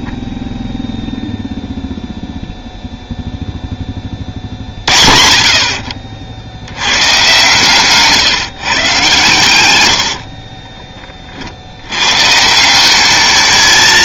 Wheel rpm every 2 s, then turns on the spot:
0, 0, 40, 90, 130, 50, 190.
10-12